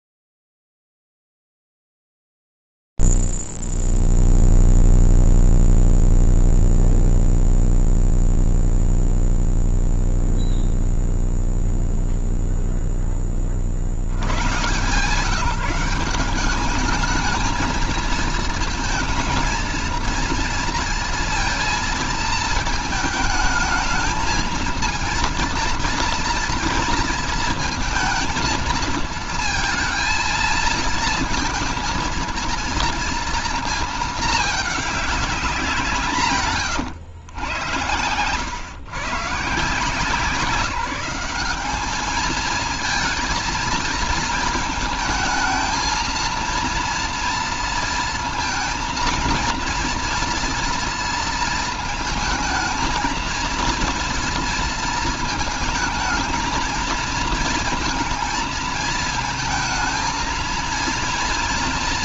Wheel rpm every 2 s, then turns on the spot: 0, 0, 0, 0, 0, 0, 0, 90, 200, 220, 230, 220, 220, 230, 230, 230, 230, 210, 120, 140, 190, 230, 220, 230, 230, 230, 230, 230, 230, 230, 230.
none